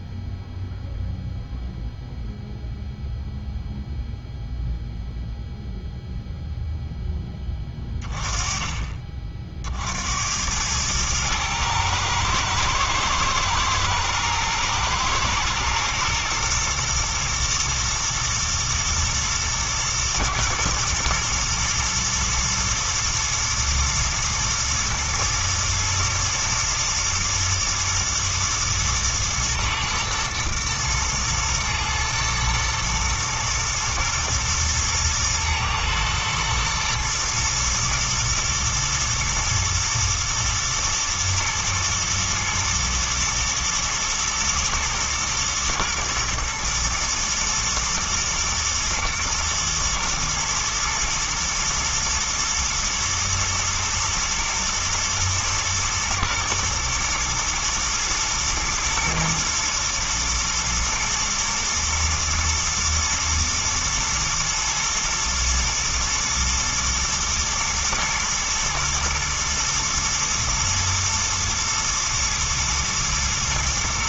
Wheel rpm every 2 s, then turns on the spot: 0, 0, 0, 10, 30, 110, 110, 120, 120, 110, 110, 120, 110, 110, 110, 110, 110, 110, 120, 120, 110, 110, 110, 120, 120, 120, 110, 110, 110, 120, 110, 110, 120, 110, 110, 110, 120.
none